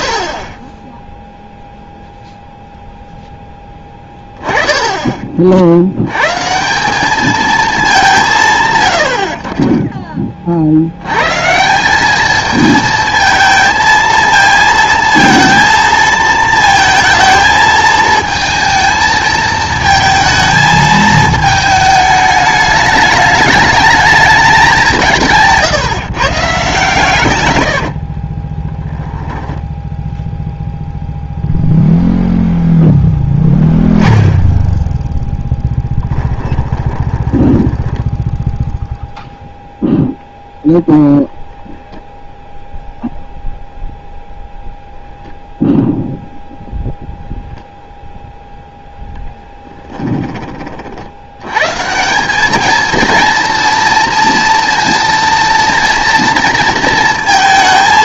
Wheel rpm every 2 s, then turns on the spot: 30, 0, 10, 190, 60, 60, 220, 230, 230, 230, 220, 210, 190, 140, 20, 0, 0, 0, 20, 0, 0, 0, 0, 0, 0, 30, 220, 230, 230.
28-30 36-38